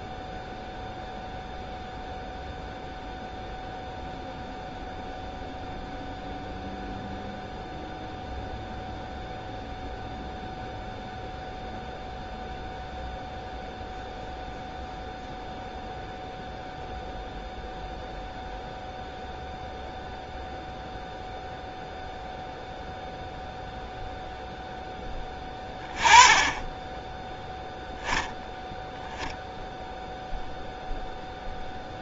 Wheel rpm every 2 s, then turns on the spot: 0, 0, 0, 0, 0, 0, 0, 0, 0, 0, 0, 0, 10, 10, 0, 0.
none